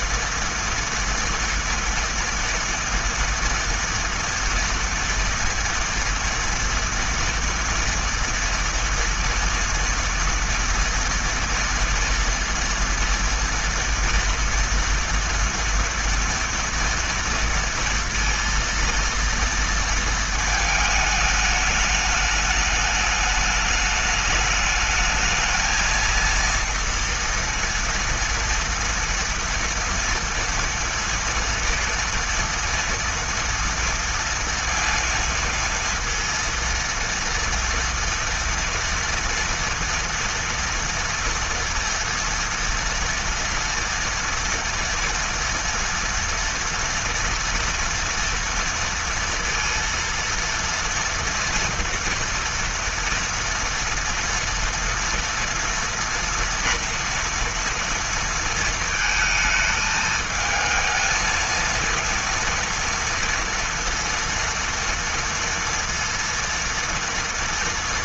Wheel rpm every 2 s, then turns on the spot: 230, 230, 230, 230, 240, 230, 230, 230, 230, 230, 220, 210, 210, 230, 230, 230, 230, 230, 230, 230, 230, 230, 230, 230, 230, 230, 230, 230, 230, 220, 220, 230, 230, 230.
none